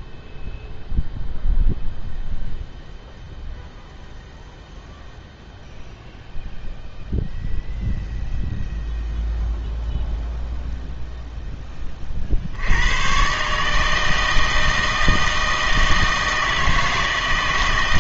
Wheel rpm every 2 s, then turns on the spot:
0, 0, 0, 0, 0, 0, 90, 160, 160.
none